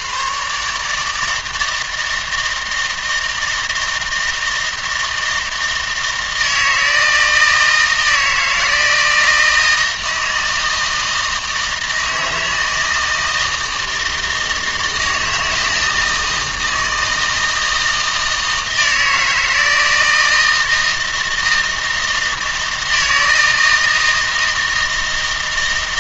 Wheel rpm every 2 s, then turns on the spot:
140, 160, 160, 160, 160, 160, 160, 160, 160, 160, 160, 160, 160.
none